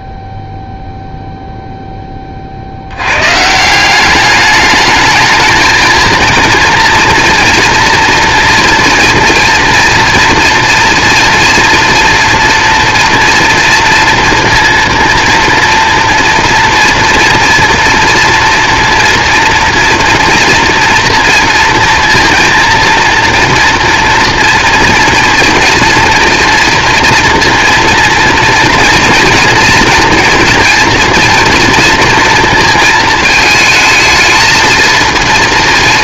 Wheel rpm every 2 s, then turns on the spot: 0, 100, 210, 230, 230, 230, 240, 230, 230, 240, 230, 230, 230, 230, 230, 230, 220, 220.
none